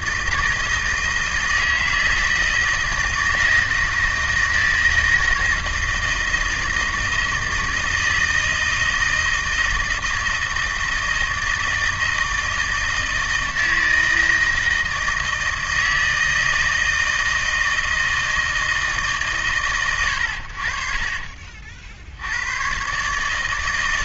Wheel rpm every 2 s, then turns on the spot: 160, 170, 160, 160, 160, 160, 160, 160, 160, 150, 40, 130.
none